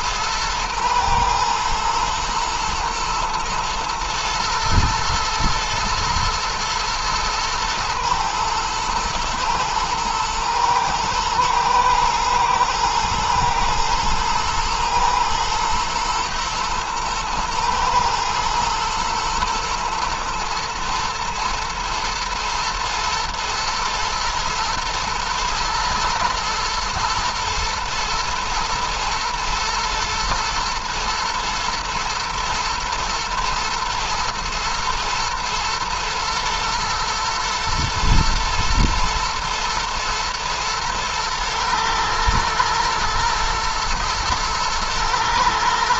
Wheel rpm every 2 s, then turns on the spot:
110, 110, 110, 110, 110, 110, 120, 110, 110, 110, 110, 110, 110, 110, 110, 110, 110, 120, 120, 110, 110, 110, 120.
none